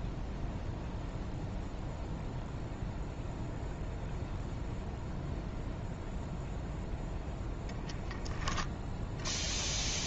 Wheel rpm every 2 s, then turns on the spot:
0, 0, 0, 0, 0.
none